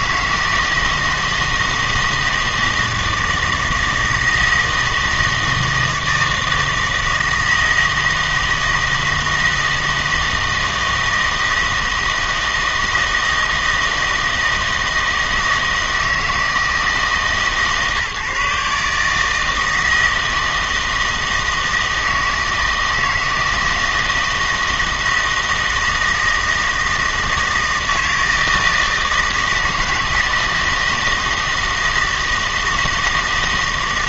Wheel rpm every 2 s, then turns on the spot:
160, 160, 160, 160, 160, 160, 160, 160, 150, 150, 160, 160, 160, 160, 160, 160, 160.
none